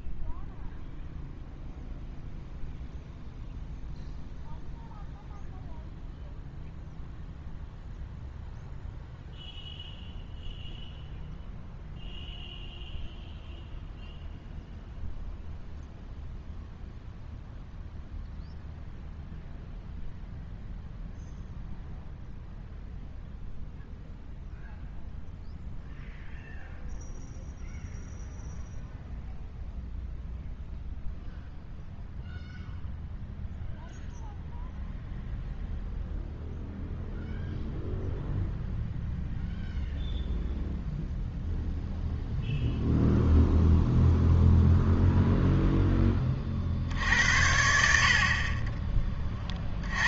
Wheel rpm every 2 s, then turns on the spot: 0, 0, 0, 0, 0, 0, 0, 0, 0, 0, 0, 0, 0, 0, 0, 0, 0, 0, 0, 0, 0, 0, 0, 50, 20.
none